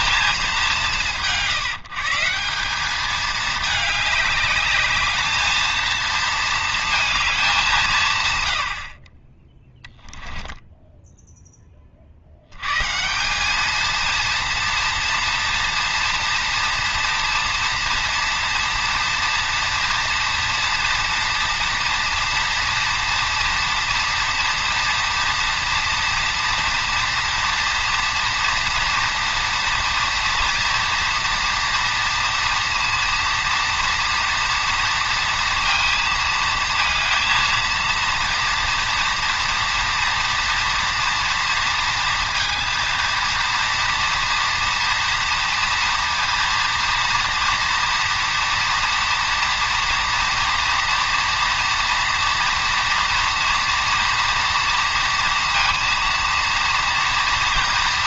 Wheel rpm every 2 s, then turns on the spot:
200, 190, 210, 220, 80, 10, 120, 230, 230, 230, 230, 230, 240, 240, 230, 240, 230, 230, 230, 230, 240, 230, 230, 230, 240, 230, 230, 230, 230.
10-12